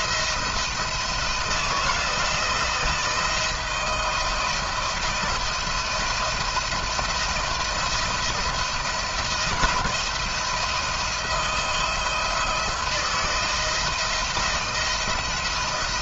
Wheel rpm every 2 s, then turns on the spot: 170, 170, 170, 170, 160, 160, 160, 170.
none